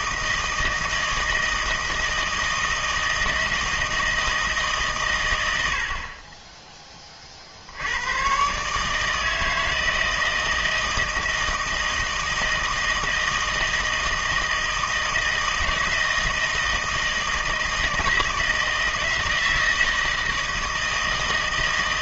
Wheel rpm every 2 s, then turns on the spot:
160, 160, 150, 20, 150, 160, 160, 160, 160, 160, 160.
none